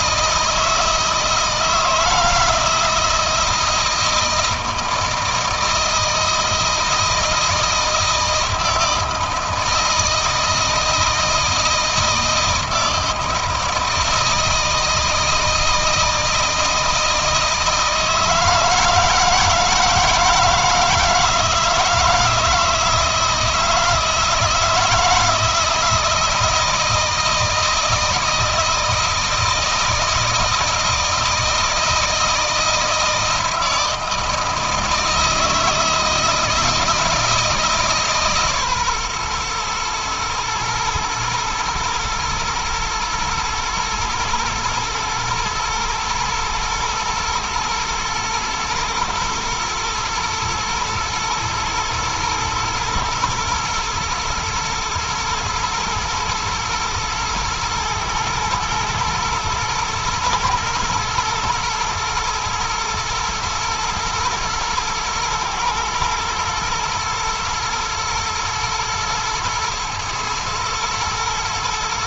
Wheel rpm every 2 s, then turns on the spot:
160, 160, 160, 160, 160, 160, 160, 160, 160, 160, 160, 160, 160, 160, 160, 160, 160, 160, 160, 140, 120, 110, 110, 110, 120, 110, 110, 110, 110, 110, 110, 120, 120, 110, 110, 110.
none